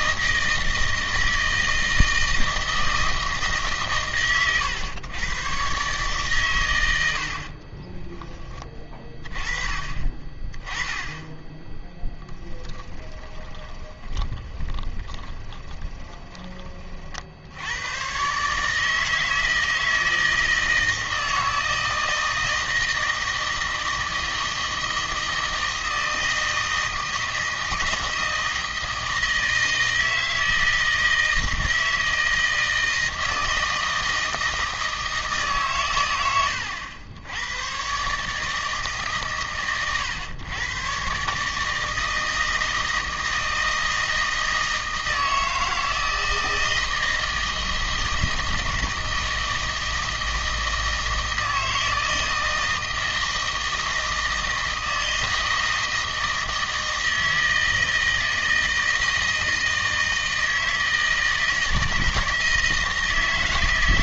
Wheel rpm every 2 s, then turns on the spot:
160, 160, 100, 100, 20, 20, 10, 10, 30, 150, 160, 160, 160, 160, 160, 160, 160, 160, 100, 150, 110, 160, 160, 160, 160, 160, 160, 160, 160, 160, 160, 160.
12-16